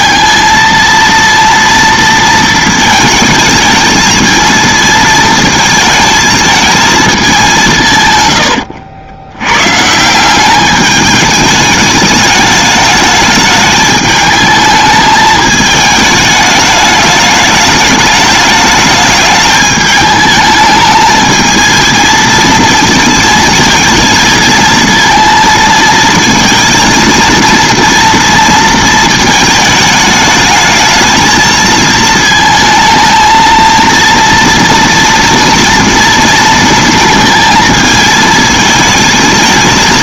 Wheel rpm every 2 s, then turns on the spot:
230, 220, 220, 220, 80, 210, 210, 220, 210, 210, 210, 230, 230, 230, 230, 210, 220, 230, 230, 220.
none